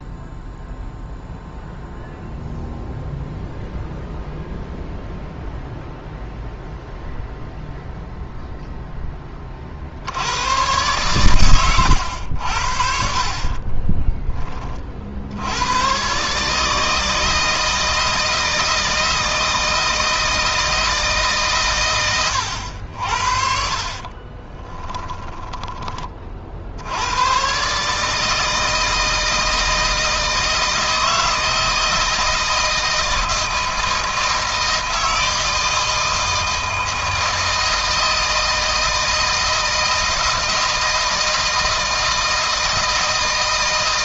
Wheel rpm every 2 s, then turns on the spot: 0, 0, 0, 0, 10, 120, 50, 50, 160, 160, 160, 70, 10, 90, 160, 160, 160, 160, 160, 160, 160, 160.
24-26